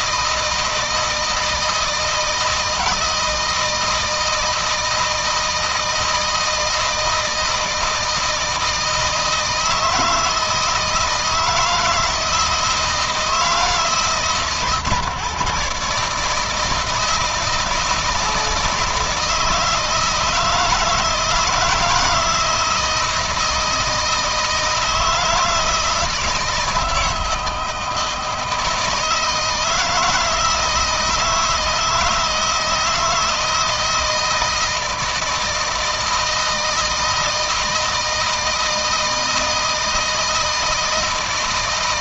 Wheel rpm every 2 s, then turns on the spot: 160, 160, 160, 160, 160, 160, 160, 150, 160, 160, 160, 160, 160, 160, 160, 160, 160, 160, 160, 160, 160.
none